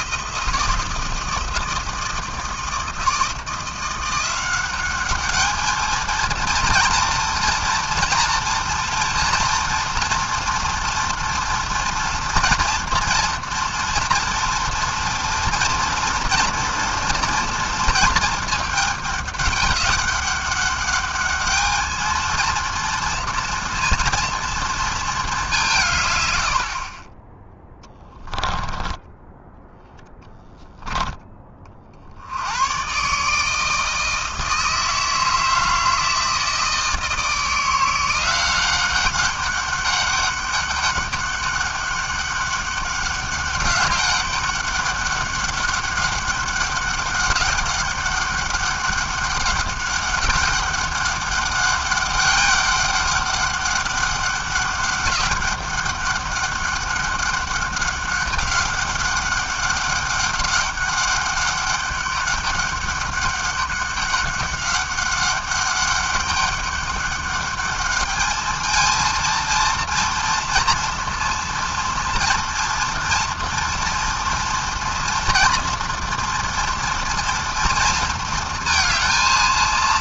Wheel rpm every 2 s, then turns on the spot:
160, 160, 200, 230, 240, 230, 230, 230, 230, 200, 210, 230, 210, 20, 10, 10, 150, 160, 160, 200, 200, 200, 200, 190, 200, 200, 200, 200, 200, 200, 200, 200, 200, 200, 230, 230, 230, 230, 230, 190.
none